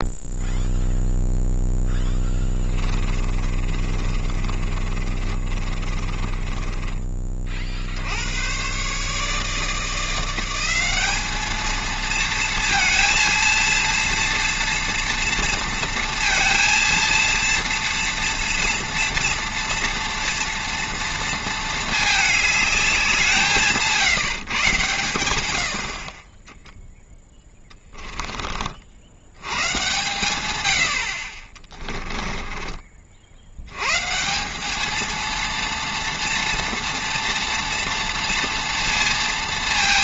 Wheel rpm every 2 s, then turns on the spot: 0, 10, 30, 20, 110, 180, 230, 230, 230, 240, 240, 210, 140, 10, 30, 110, 20, 190, 240, 230.
2-8 32-34